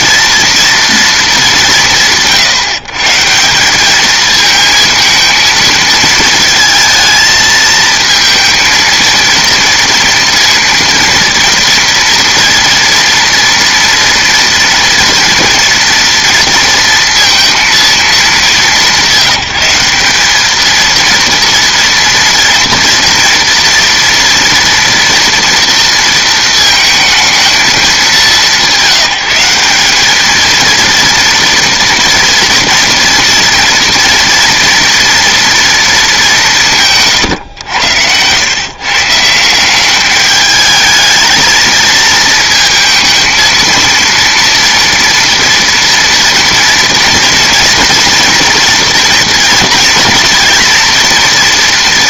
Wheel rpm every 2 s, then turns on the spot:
230, 140, 220, 220, 230, 230, 230, 230, 230, 200, 210, 230, 240, 230, 200, 220, 230, 240, 170, 130, 220, 220, 230, 230, 230, 230.
none